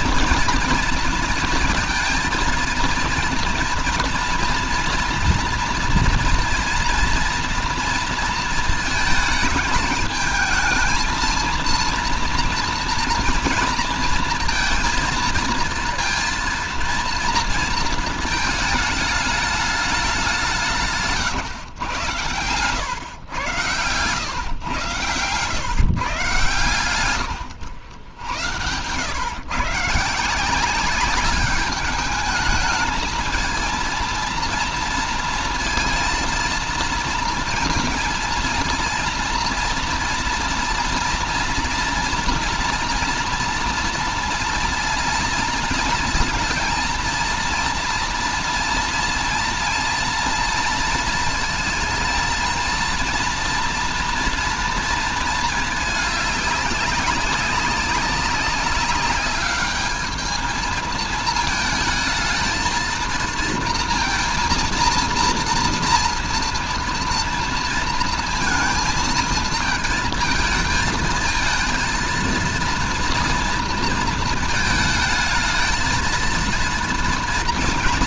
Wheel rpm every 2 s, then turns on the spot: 240, 230, 230, 230, 220, 220, 230, 230, 230, 220, 170, 90, 120, 120, 110, 190, 220, 230, 230, 230, 230, 240, 240, 230, 230, 230, 230, 230, 200, 200, 220, 220, 230, 240, 230, 230, 230, 220, 230.
20-22